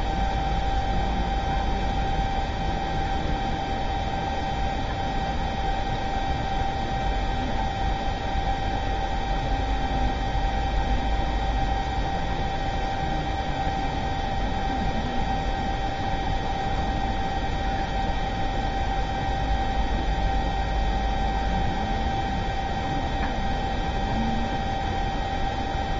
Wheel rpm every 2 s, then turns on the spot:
0, 0, 0, 0, 0, 0, 0, 0, 0, 0, 0, 0, 0.
none